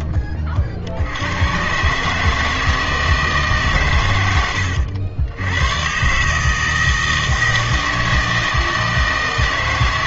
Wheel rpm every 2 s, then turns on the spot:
70, 160, 90, 160, 160.
none